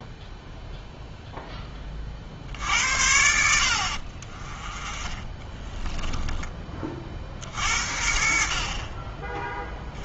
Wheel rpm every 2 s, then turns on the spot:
0, 80, 20, 40, 40.
4-6